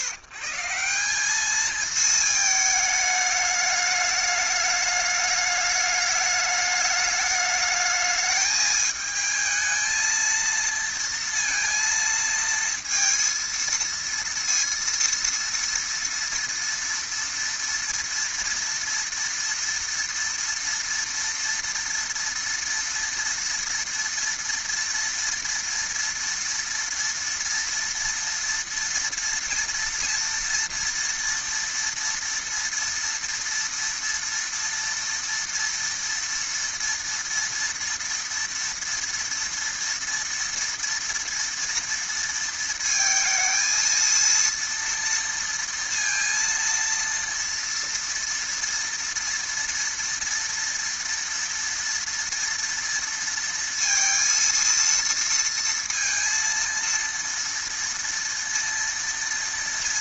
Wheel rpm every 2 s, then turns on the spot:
160, 220, 210, 210, 220, 220, 230, 230, 230, 240, 230, 230, 230, 230, 230, 240, 230, 230, 230, 230, 230, 230, 230, 230, 230, 230, 230, 230, 230, 230.
none